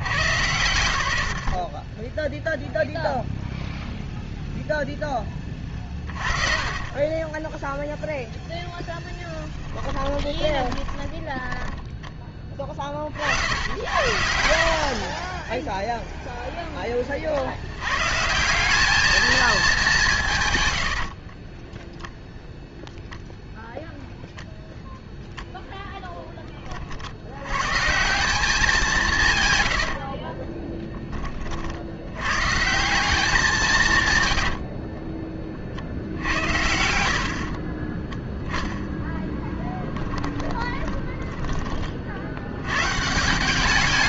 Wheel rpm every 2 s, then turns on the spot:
110, 0, 0, 30, 0, 10, 20, 50, 10, 190, 110, 0, 0, 30, 180, 20, 170, 50, 80, 10, 20, 120.
6-8 10-12 14-16 34-36 40-42